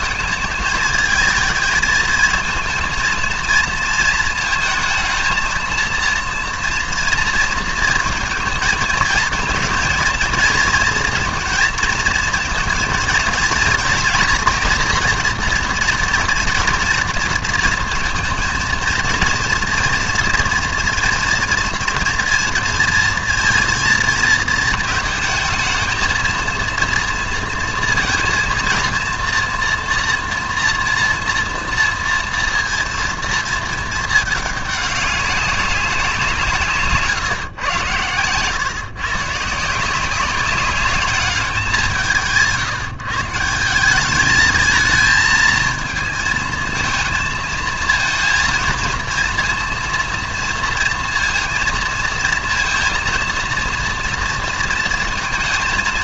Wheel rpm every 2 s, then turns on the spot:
220, 230, 220, 230, 220, 230, 230, 230, 230, 230, 230, 230, 220, 230, 230, 230, 230, 210, 150, 130, 200, 160, 220, 220, 220, 230, 230, 230.
none